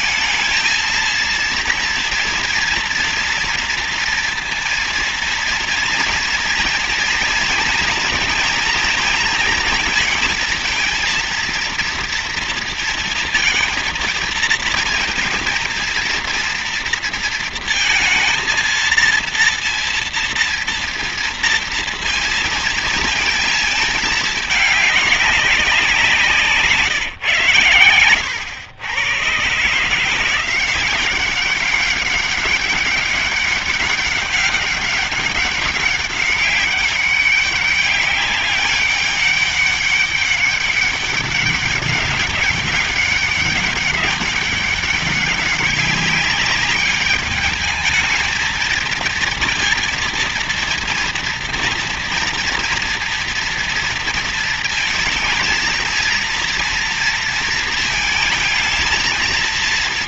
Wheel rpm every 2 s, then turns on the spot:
230, 230, 230, 230, 230, 230, 230, 230, 230, 230, 230, 230, 200, 150, 110, 190, 200, 200, 200, 200, 200, 200, 200, 210, 230, 230, 230, 230, 230, 220.
none